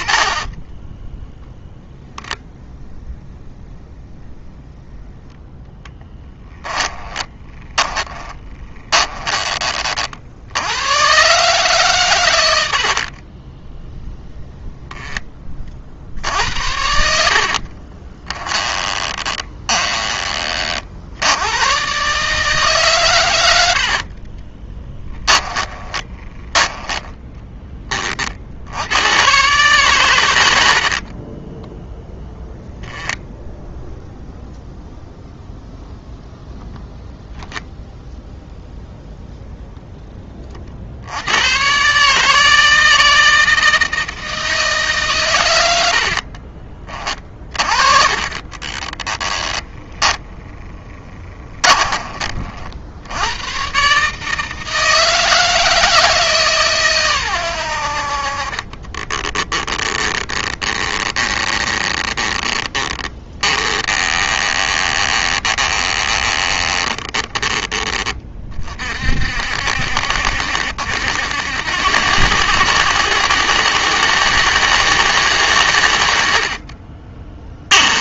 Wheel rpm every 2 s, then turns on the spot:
10, 10, 10, 20, 20, 100, 70, 10, 70, 20, 50, 140, 10, 20, 90, 50, 10, 10, 10, 10, 60, 160, 150, 30, 20, 20, 80, 160, 130, 40, 20, 20, 20, 20, 50, 80, 110, 110, 30.
0-2 6-10 12-14 18-20 24-26 30-32 48-52 58-68 76-78